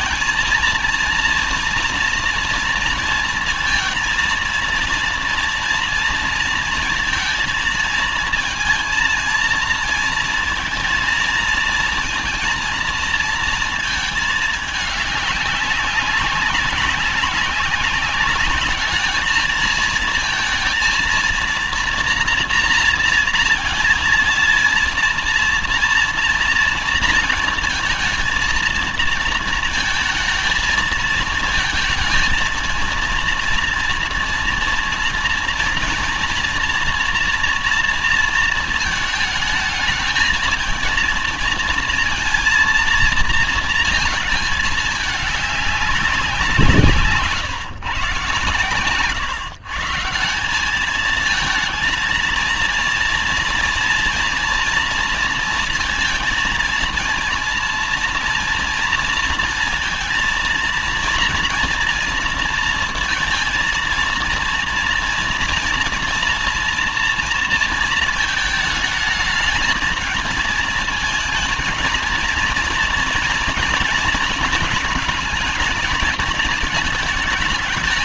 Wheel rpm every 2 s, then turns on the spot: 230, 230, 230, 230, 230, 230, 230, 210, 200, 200, 220, 230, 230, 230, 230, 230, 230, 230, 230, 220, 220, 230, 220, 190, 140, 180, 230, 230, 230, 230, 230, 230, 230, 230, 220, 220, 230, 220, 220.
none